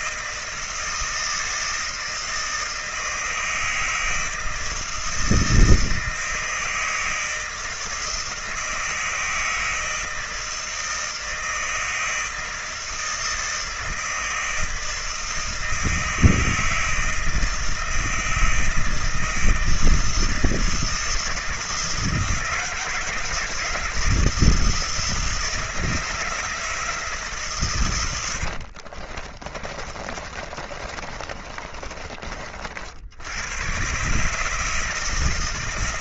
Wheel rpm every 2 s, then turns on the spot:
160, 160, 160, 160, 160, 160, 160, 160, 160, 160, 160, 160, 160, 160, 70, 30, 60, 160.
28-32